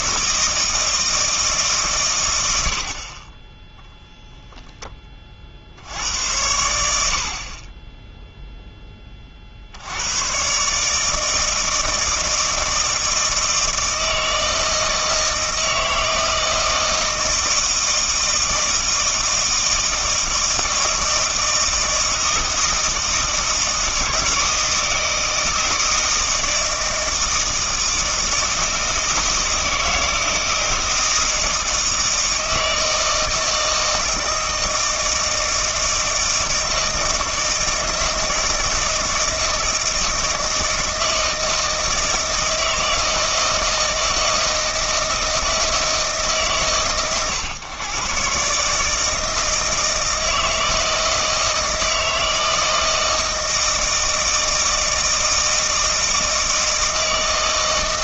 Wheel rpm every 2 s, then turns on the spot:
160, 70, 10, 80, 20, 140, 160, 160, 160, 160, 160, 160, 160, 160, 160, 160, 160, 160, 160, 160, 160, 160, 160, 120, 150, 160, 160, 160, 160.
none